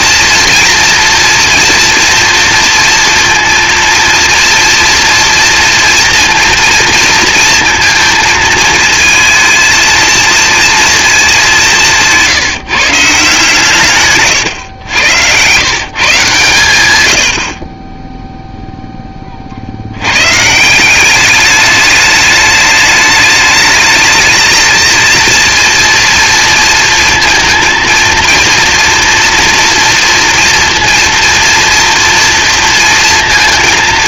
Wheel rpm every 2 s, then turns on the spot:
230, 230, 240, 230, 220, 230, 150, 100, 110, 10, 180, 210, 220, 230, 230, 230, 230.
none